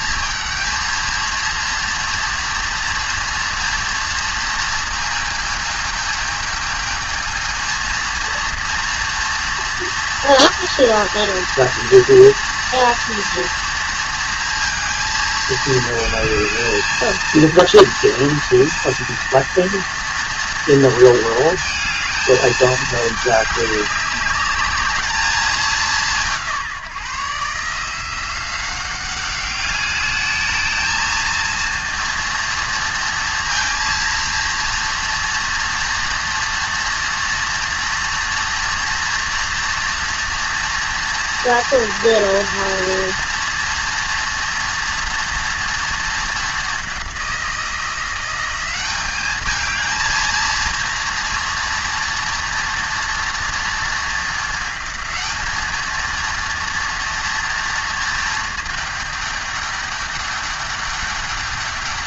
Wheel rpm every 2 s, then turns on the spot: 220, 230, 230, 220, 230, 230, 230, 230, 220, 230, 230, 220, 210, 160, 180, 220, 230, 230, 230, 230, 230, 230, 230, 210, 190, 230, 230, 220, 230, 220, 200.
none